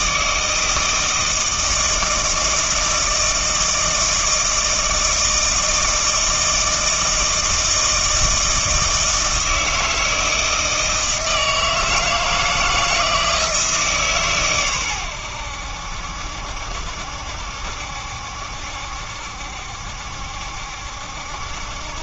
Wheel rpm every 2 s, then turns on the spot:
160, 160, 160, 160, 160, 160, 160, 120, 70, 70, 70.
none